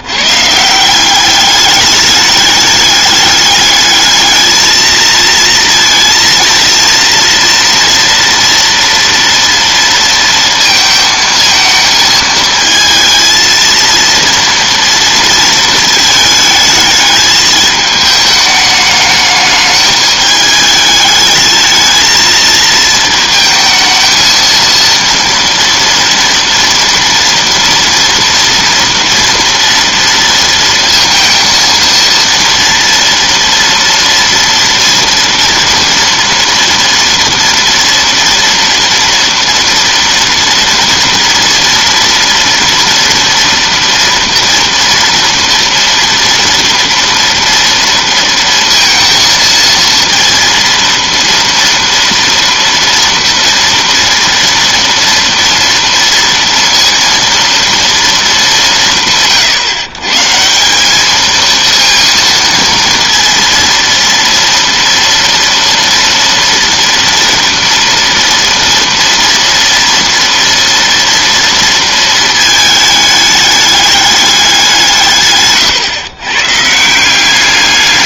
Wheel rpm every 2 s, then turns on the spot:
150, 210, 220, 230, 230, 230, 220, 230, 220, 210, 210, 220, 230, 230, 230, 230, 230, 230, 230, 230, 230, 230, 230, 230, 230, 230, 230, 230, 230, 190, 180, 230, 230, 230, 230, 230, 220, 190, 150.
none